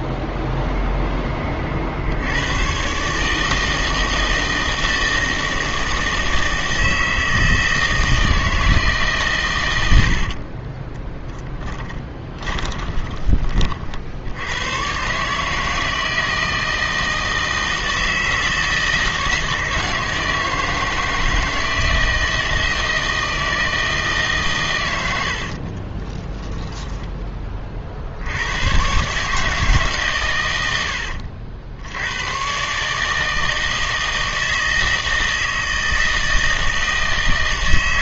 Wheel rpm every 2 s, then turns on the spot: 0, 120, 160, 160, 160, 20, 20, 110, 160, 160, 160, 160, 110, 10, 120, 80, 140, 160, 160.
10-14 30-32